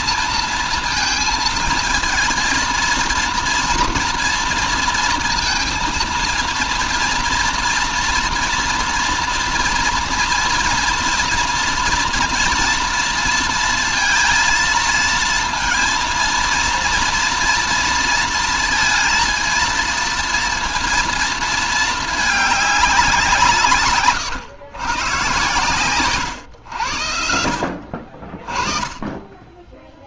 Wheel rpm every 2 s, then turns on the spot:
230, 230, 230, 230, 230, 230, 230, 230, 240, 230, 230, 190, 120, 80, 20.
none